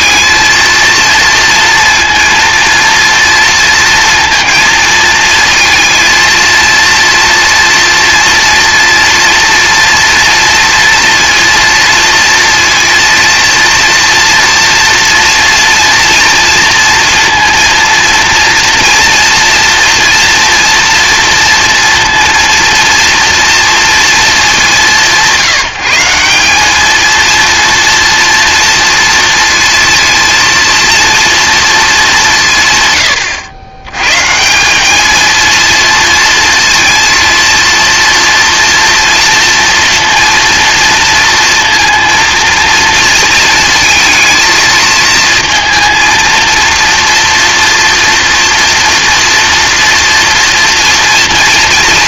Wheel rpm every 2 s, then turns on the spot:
230, 230, 230, 230, 230, 230, 230, 230, 230, 230, 240, 230, 210, 200, 230, 230, 150, 170, 230, 230, 230, 230, 220, 230, 230, 230.
none